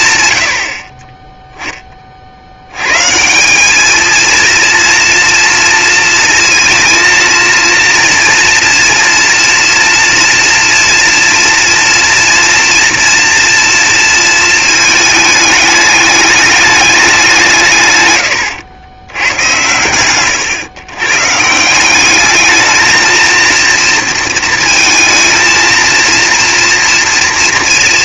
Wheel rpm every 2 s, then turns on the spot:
10, 210, 230, 230, 240, 230, 230, 210, 120, 110, 170, 230, 230, 230.
none